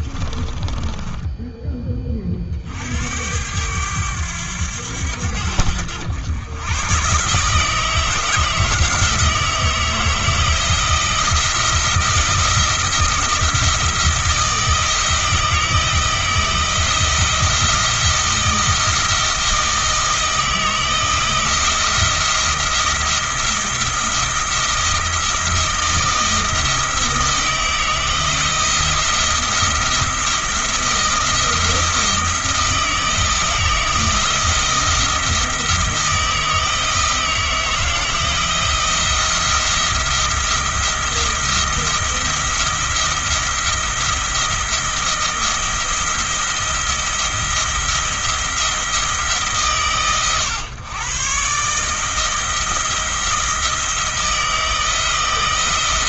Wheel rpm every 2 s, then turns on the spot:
20, 60, 90, 120, 160, 170, 160, 170, 170, 170, 160, 170, 170, 160, 170, 170, 160, 170, 160, 170, 170, 170, 170, 170, 170, 130, 160, 160.
0-2